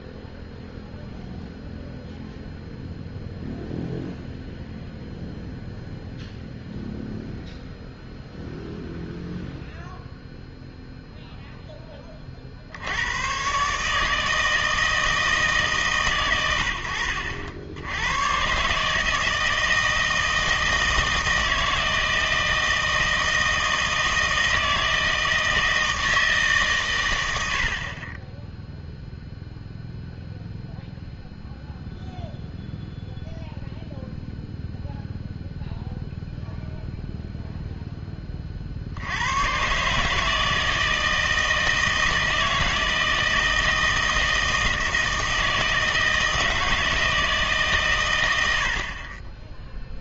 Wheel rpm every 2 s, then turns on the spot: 0, 0, 0, 0, 0, 0, 70, 160, 90, 140, 160, 160, 160, 130, 0, 0, 0, 0, 0, 60, 160, 160, 160, 160, 60.
none